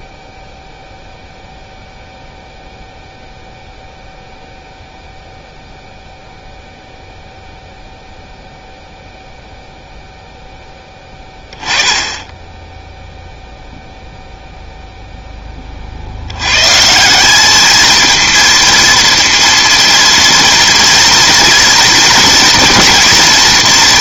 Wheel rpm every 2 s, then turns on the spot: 0, 0, 0, 0, 0, 10, 10, 0, 130, 230, 230, 240.
none